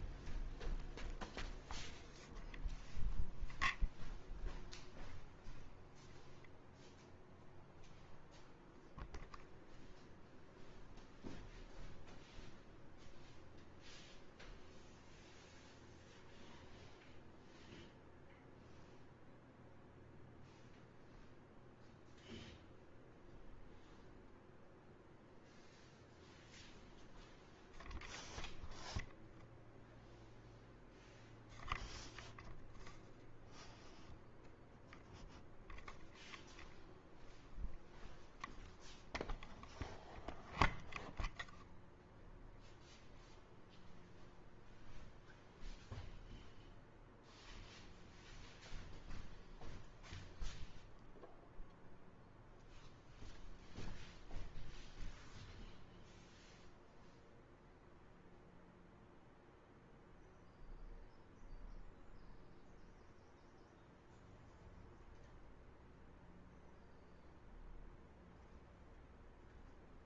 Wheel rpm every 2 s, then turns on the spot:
0, 0, 0, 0, 0, 0, 0, 0, 0, 0, 0, 0, 0, 0, 0, 0, 0, 0, 0, 0, 0, 0, 0, 0, 0, 0, 0, 0, 0, 0, 0, 0, 0, 0, 0.
none